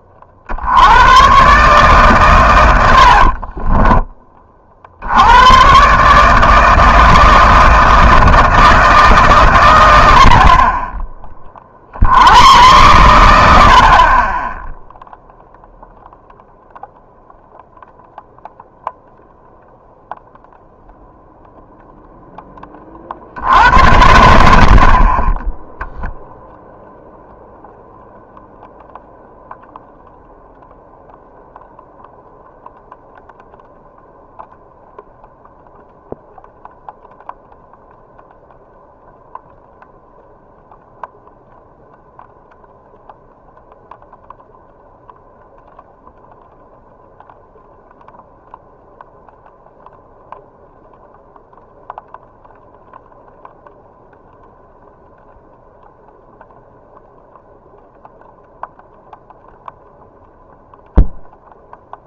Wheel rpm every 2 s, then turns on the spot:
80, 110, 40, 160, 160, 30, 100, 10, 0, 0, 0, 20, 60, 0, 0, 0, 0, 0, 0, 0, 0, 0, 0, 0, 0, 0, 0, 0, 0, 0, 0.
none